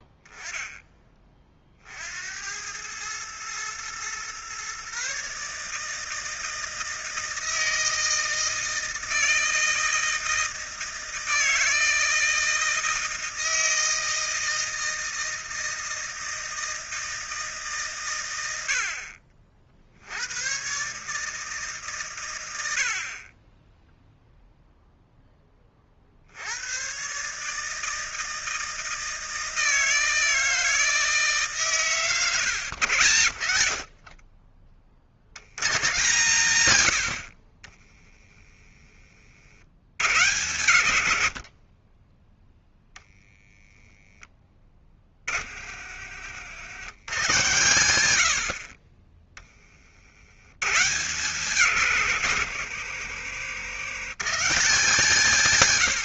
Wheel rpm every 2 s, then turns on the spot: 10, 100, 140, 160, 160, 160, 160, 160, 160, 70, 130, 70, 0, 110, 160, 160, 100, 40, 90, 20, 120, 0, 20, 110, 30, 130, 90, 160.
none